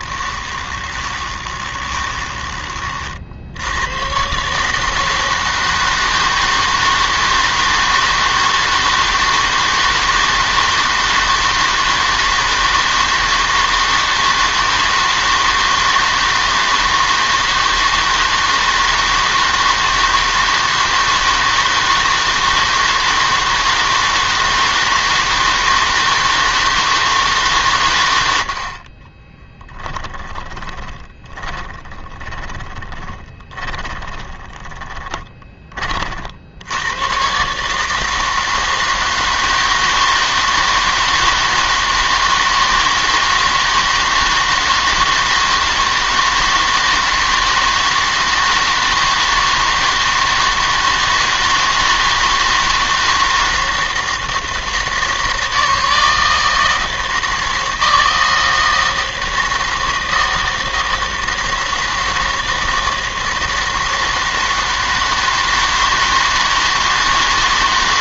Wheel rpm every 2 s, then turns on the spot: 10, 30, 150, 160, 160, 160, 160, 160, 160, 160, 160, 160, 160, 160, 60, 20, 30, 10, 90, 160, 160, 160, 160, 160, 160, 160, 160, 160, 160, 160, 160, 160, 160, 160.
0-2 30-36